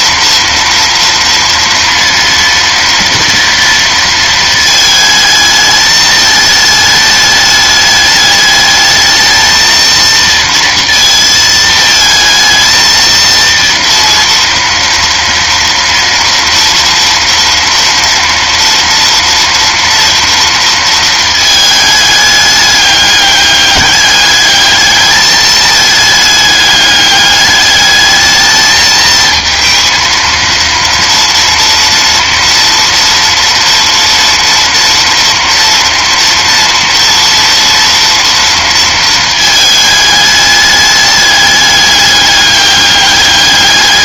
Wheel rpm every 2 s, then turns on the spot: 230, 230, 220, 210, 210, 230, 230, 230, 230, 230, 230, 210, 210, 210, 220, 230, 230, 230, 230, 230, 210, 200.
none